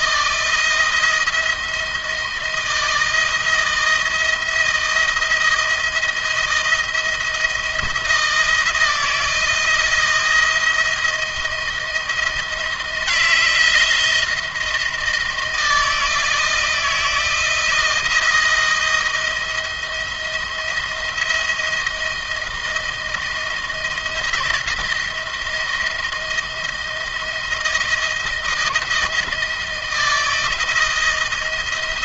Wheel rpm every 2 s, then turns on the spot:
170, 170, 170, 170, 170, 170, 170, 160, 160, 170, 170, 160, 170, 170, 160, 160.
none